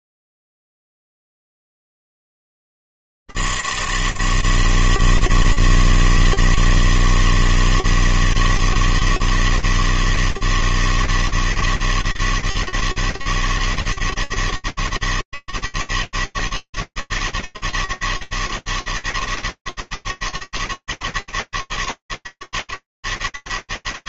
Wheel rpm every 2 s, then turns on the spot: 70, 160, 160, 160, 160, 160, 160, 160, 160, 160, 160, 160.
none